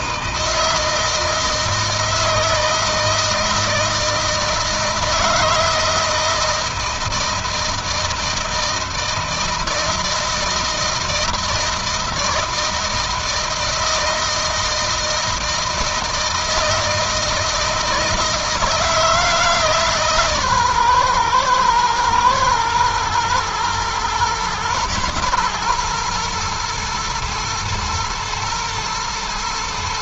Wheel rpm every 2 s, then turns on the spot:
160, 160, 160, 160, 160, 160, 160, 160, 160, 150, 120, 120, 120, 120, 110.
none